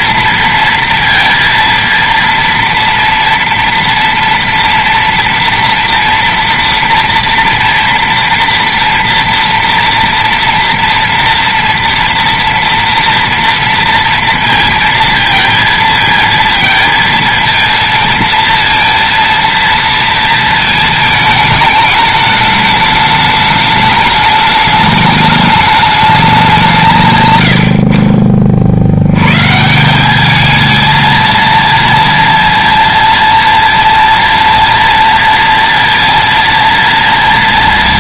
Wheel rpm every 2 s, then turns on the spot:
230, 240, 230, 230, 230, 230, 230, 230, 230, 230, 230, 210, 210, 190, 30, 210, 230, 230, 230.
none